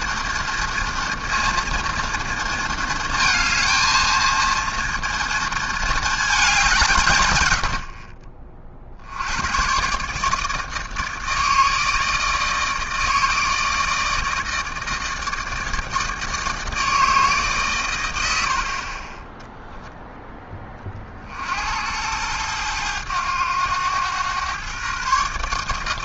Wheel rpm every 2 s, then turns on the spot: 230, 230, 230, 190, 50, 150, 160, 160, 160, 50, 20, 100, 120.
none